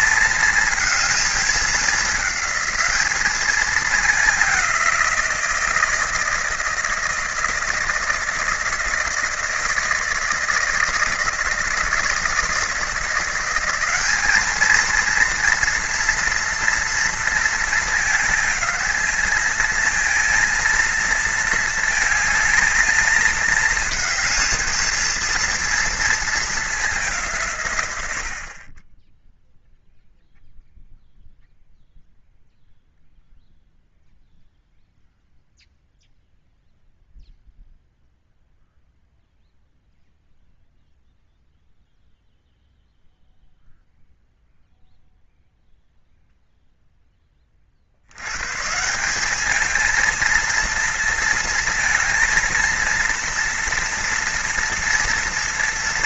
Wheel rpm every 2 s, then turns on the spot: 220, 210, 190, 160, 160, 160, 160, 220, 230, 220, 230, 220, 220, 200, 30, 0, 0, 0, 0, 0, 0, 0, 0, 0, 150, 230, 230, 240.
none